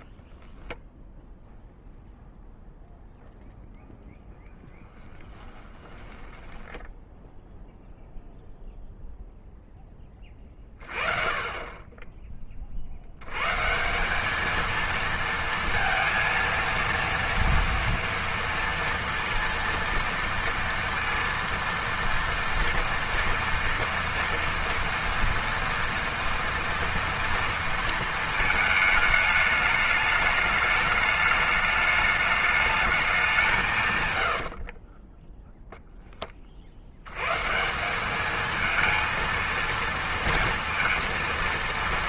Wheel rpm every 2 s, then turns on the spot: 0, 0, 20, 10, 0, 30, 40, 230, 230, 230, 230, 230, 230, 240, 220, 210, 210, 50, 50, 220, 230.
4-8 34-36